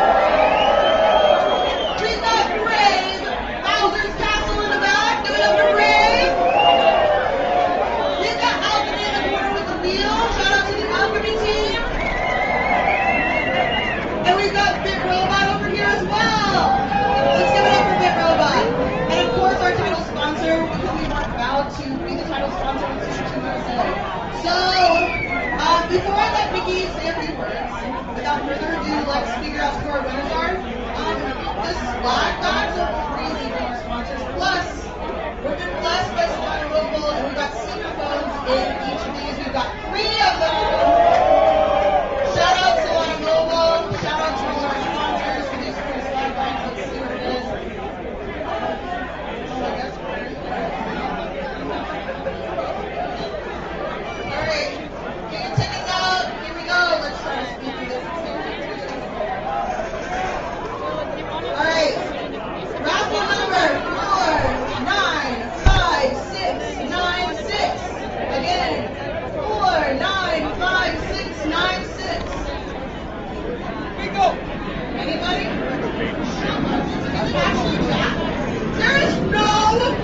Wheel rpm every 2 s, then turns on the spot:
0, 0, 10, 10, 0, 20, 10, 0, 0, 0, 10, 0, 0, 0, 10, 0, 10, 0, 0, 0, 0, 0, 0, 0, 0, 0, 10, 0, 0, 10, 20, 0, 20, 10, 0, 10, 10, 0, 0, 20.
10-14 20-22 72-74